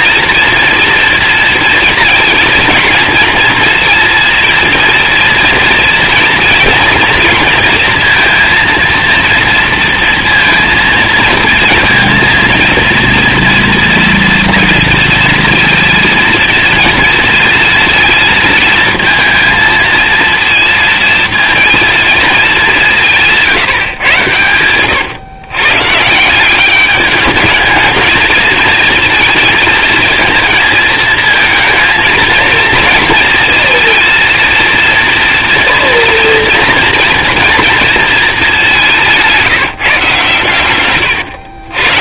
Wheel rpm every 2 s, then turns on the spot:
230, 230, 230, 230, 230, 230, 230, 230, 220, 230, 230, 140, 130, 220, 220, 220, 220, 240, 230, 150, 120.
none